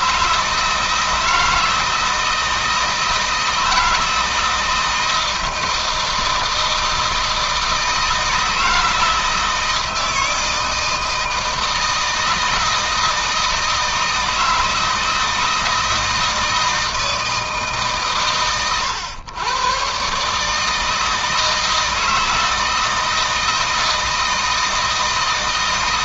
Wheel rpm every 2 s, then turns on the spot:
160, 160, 160, 160, 160, 160, 160, 160, 160, 110, 160, 160, 160.
none